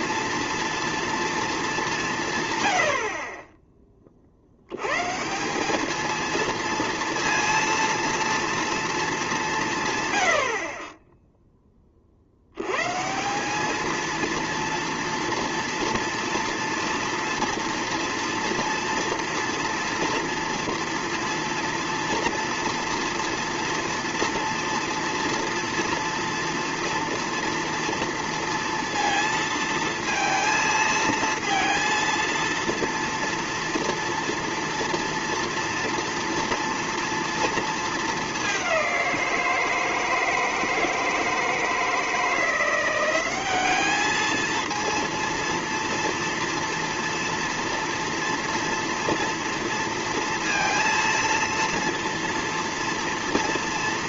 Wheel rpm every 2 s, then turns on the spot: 230, 120, 90, 230, 230, 40, 110, 230, 230, 230, 230, 230, 230, 230, 230, 230, 230, 230, 230, 200, 160, 170, 230, 230, 230, 230, 230.
none